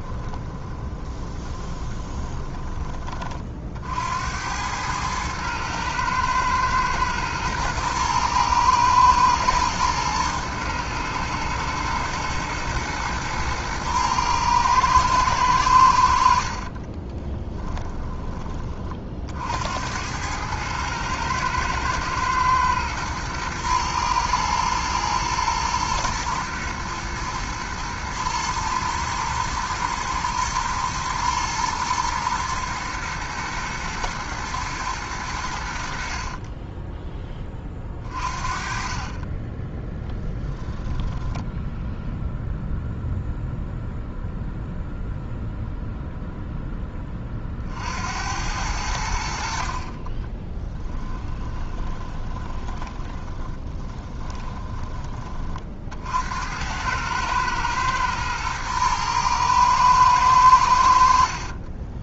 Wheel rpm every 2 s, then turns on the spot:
20, 20, 100, 120, 110, 110, 120, 110, 40, 40, 110, 110, 120, 120, 110, 110, 110, 110, 20, 40, 10, 0, 0, 10, 80, 10, 20, 20, 90, 110, 70.
0-2 16-18 36-38 40-42 50-54